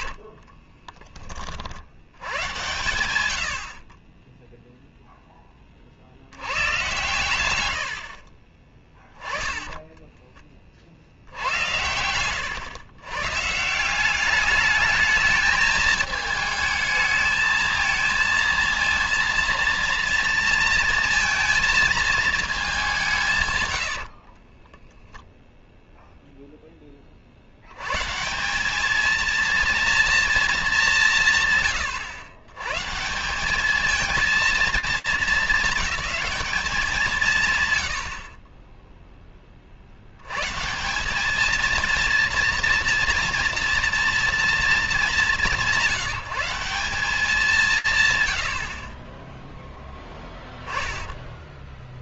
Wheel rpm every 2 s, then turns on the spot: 20, 100, 0, 120, 20, 70, 120, 210, 220, 230, 230, 180, 0, 20, 210, 190, 150, 220, 190, 10, 170, 230, 230, 190, 40, 10.
8-10